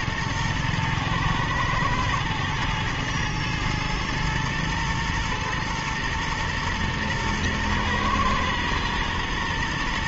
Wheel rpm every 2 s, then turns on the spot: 110, 110, 120, 120, 120.
none